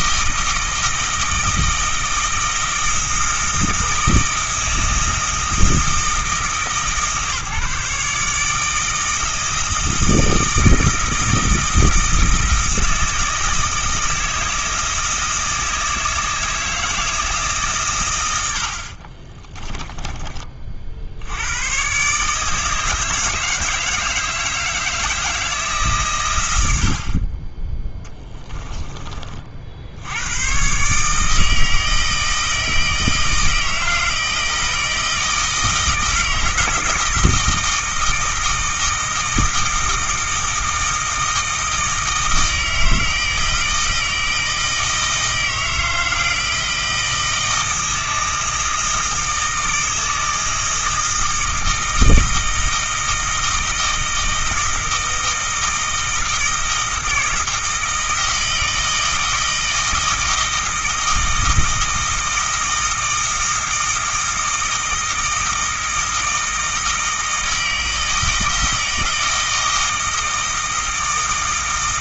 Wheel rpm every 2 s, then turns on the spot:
160, 160, 160, 150, 160, 160, 160, 160, 160, 60, 50, 160, 160, 70, 20, 140, 160, 160, 160, 160, 160, 160, 160, 160, 160, 160, 160, 160, 160, 160, 160, 160, 160, 160, 160, 160.
18-20